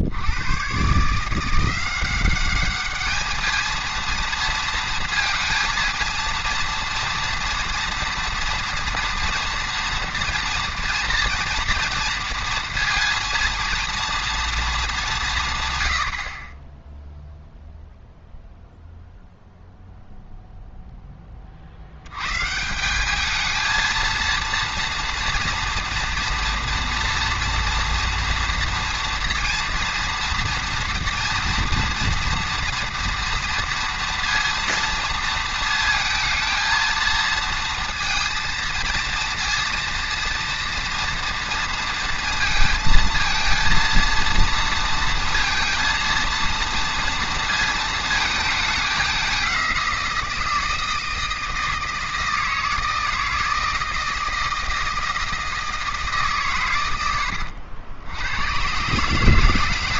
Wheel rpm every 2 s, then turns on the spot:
110, 200, 230, 230, 230, 230, 230, 220, 30, 0, 0, 150, 230, 230, 230, 230, 230, 230, 220, 230, 230, 230, 230, 230, 210, 160, 160, 160, 120, 110.
none